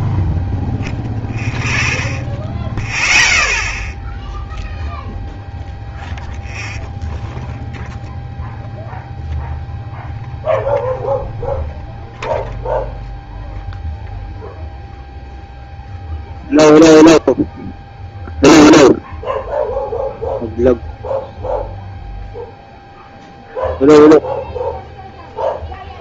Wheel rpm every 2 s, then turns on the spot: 0, 0, 0, 0, 0, 0, 0, 0, 0, 0, 0, 0, 0.
none